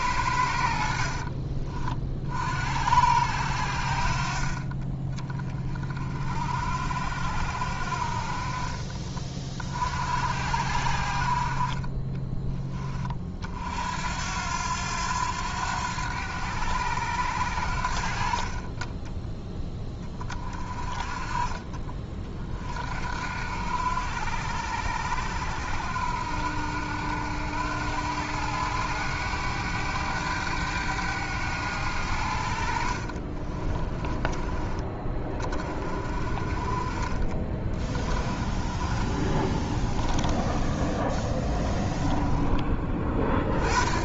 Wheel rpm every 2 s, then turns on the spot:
60, 60, 30, 60, 30, 60, 20, 90, 90, 20, 30, 50, 80, 80, 100, 100, 50, 20, 30, 30, 20, 20.
32-34 38-40